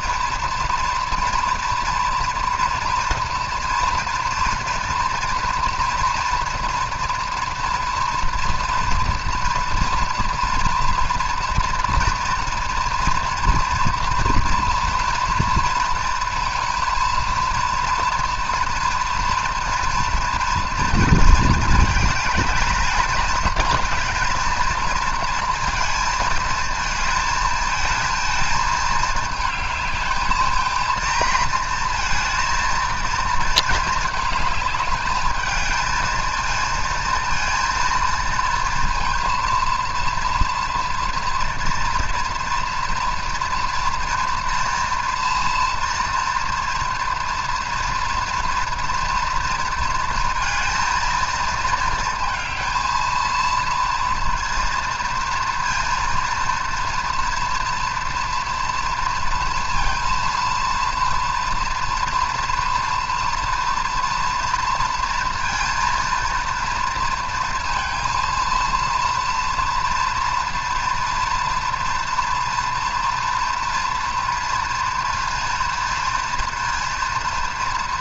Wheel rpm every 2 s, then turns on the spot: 230, 230, 230, 230, 240, 230, 230, 230, 230, 230, 220, 220, 230, 220, 220, 230, 220, 210, 230, 230, 230, 230, 240, 230, 230, 220, 230, 230, 230, 230, 230, 230, 230, 230, 230, 230, 230, 230, 230.
none